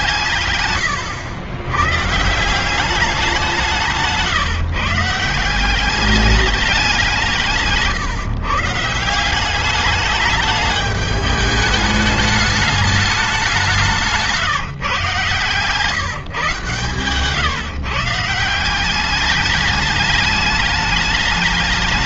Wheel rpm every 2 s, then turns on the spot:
110, 180, 180, 160, 180, 210, 190, 140, 140, 210, 190.
none